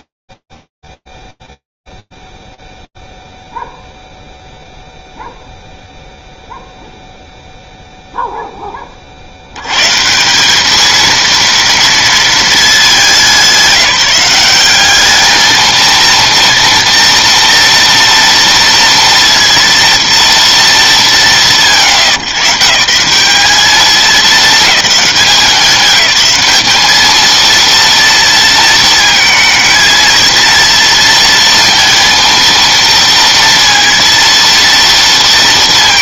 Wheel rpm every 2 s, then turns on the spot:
0, 0, 0, 0, 10, 200, 210, 200, 230, 230, 210, 140, 210, 200, 230, 230, 230, 230.
none